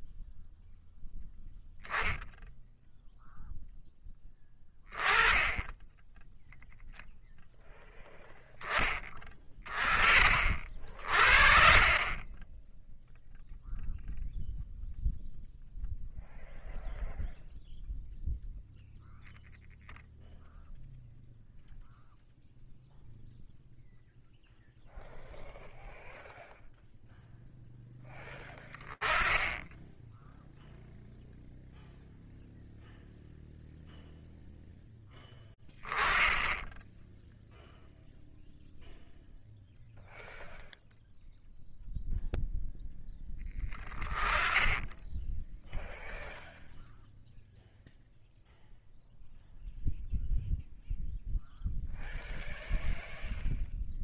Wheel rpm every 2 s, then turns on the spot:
0, 0, 20, 0, 10, 40, 20, 0, 0, 0, 0, 0, 0, 0, 10, 0, 0, 10, 10, 0, 0, 10, 10, 0, 0, 0, 0.
none